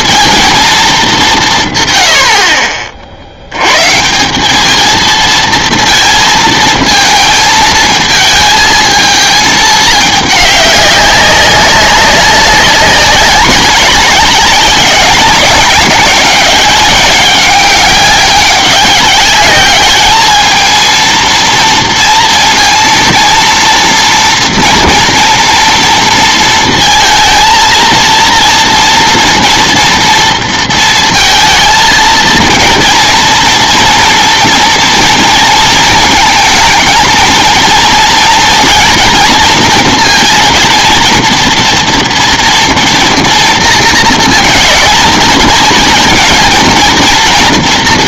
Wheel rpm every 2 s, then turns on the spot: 220, 50, 210, 220, 220, 200, 190, 190, 190, 200, 220, 230, 230, 230, 230, 230, 230, 230, 220, 230, 230, 230, 210, 230.
none